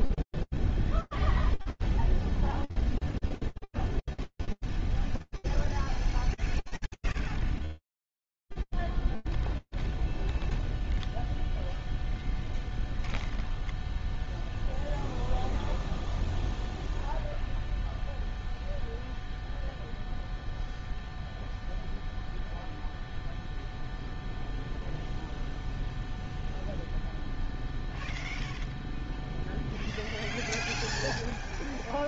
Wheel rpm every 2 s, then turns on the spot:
0, 0, 0, 0, 0, 0, 0, 0, 0, 0, 0, 0, 0, 0, 0, 0.
none